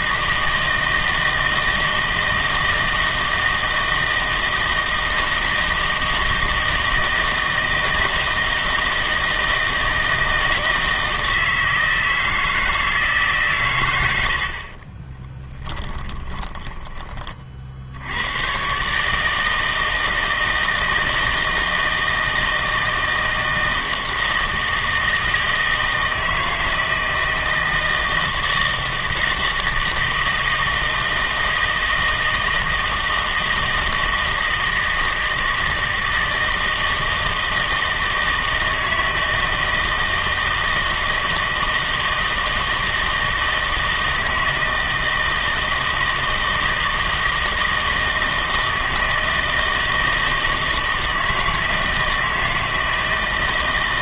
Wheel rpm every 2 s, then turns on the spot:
160, 160, 160, 160, 160, 160, 160, 90, 10, 120, 160, 160, 160, 160, 160, 160, 160, 160, 160, 160, 160, 160, 160, 160, 160, 160, 160.
none